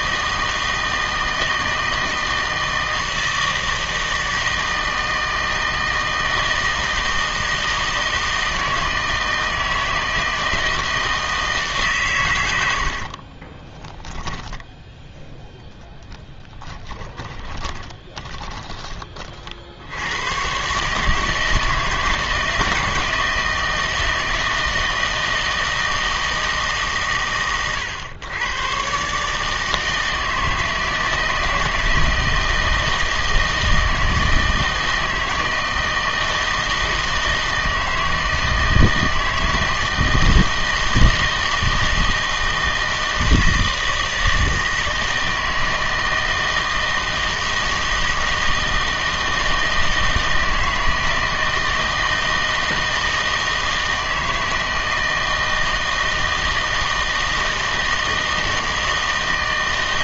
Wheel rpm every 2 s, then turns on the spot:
160, 160, 160, 160, 160, 160, 80, 10, 30, 20, 130, 160, 160, 150, 130, 160, 160, 160, 160, 160, 160, 160, 160, 160, 160, 160, 160, 160, 160, 160.
12-14 16-18